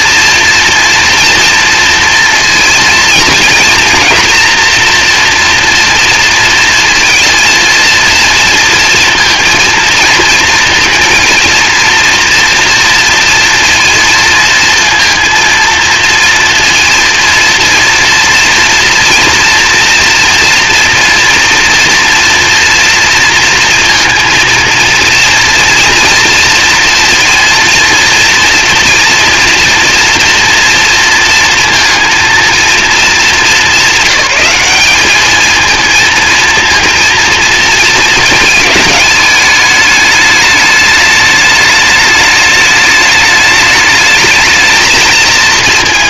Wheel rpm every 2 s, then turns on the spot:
240, 230, 230, 230, 230, 230, 230, 230, 230, 230, 240, 240, 230, 230, 240, 230, 230, 200, 230, 210, 210, 210, 220.
none